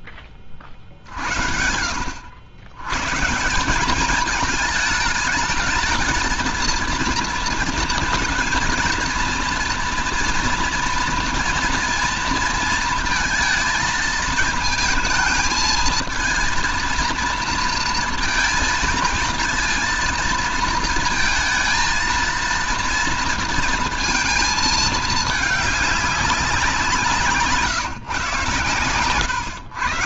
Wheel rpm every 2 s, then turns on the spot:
50, 110, 220, 230, 230, 240, 230, 220, 230, 220, 220, 230, 220, 180, 120.
none